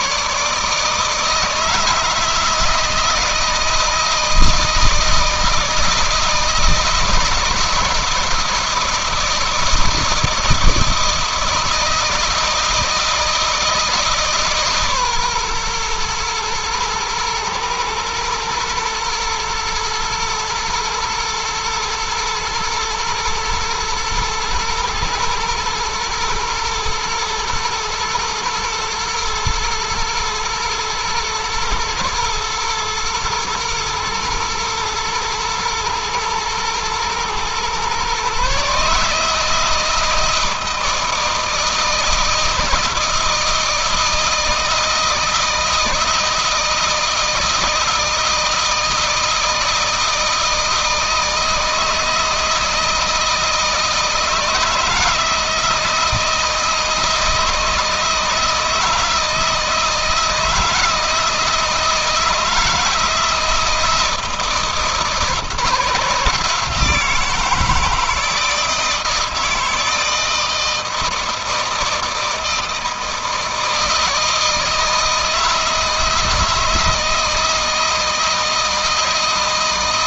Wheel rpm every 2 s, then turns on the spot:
160, 160, 160, 160, 160, 160, 160, 140, 120, 120, 120, 120, 110, 120, 120, 110, 110, 110, 110, 150, 160, 160, 160, 160, 160, 160, 160, 160, 160, 160, 160, 160, 160, 160, 160, 160, 160, 160, 160, 160.
none